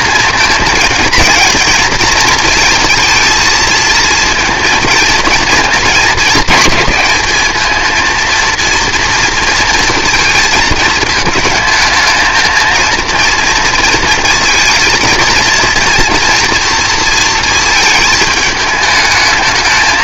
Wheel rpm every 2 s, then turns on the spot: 230, 230, 230, 220, 230, 220, 230, 230, 240, 220.
none